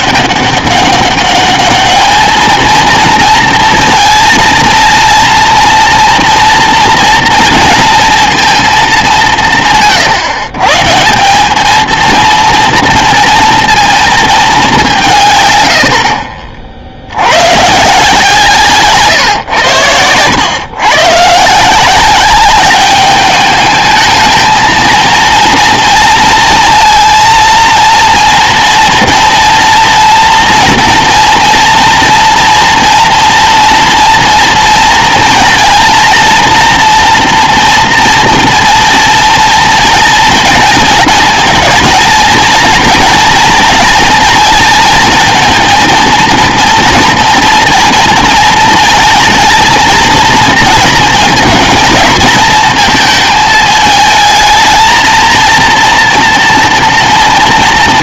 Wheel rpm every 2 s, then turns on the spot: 200, 220, 230, 230, 210, 140, 230, 180, 50, 140, 120, 200, 230, 230, 230, 230, 230, 230, 230, 230, 220, 230, 230, 230, 220, 230, 220, 220, 230.
none